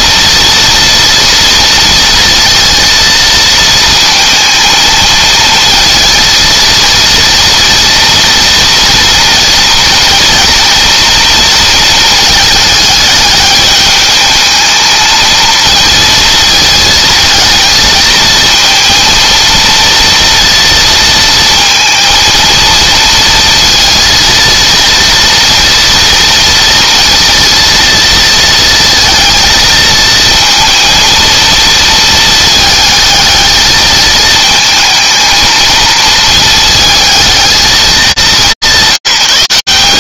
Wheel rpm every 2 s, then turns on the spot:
230, 230, 230, 230, 230, 230, 210, 220, 220, 230, 230, 230, 230, 230, 230, 230, 220, 220, 220, 190.
none